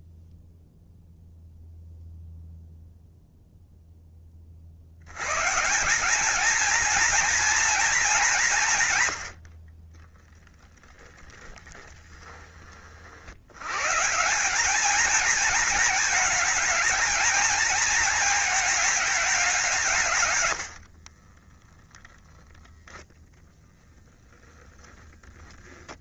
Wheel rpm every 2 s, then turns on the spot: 0, 0, 70, 230, 150, 10, 40, 220, 230, 210, 60, 10, 0.
10-12 20-22